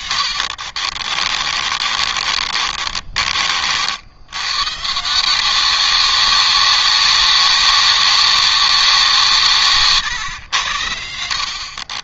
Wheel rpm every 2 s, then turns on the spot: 40, 30, 160, 200, 180, 70.
0-4